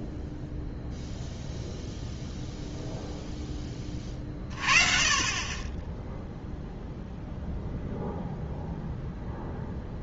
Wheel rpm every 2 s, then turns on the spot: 0, 0, 40, 0, 0.
none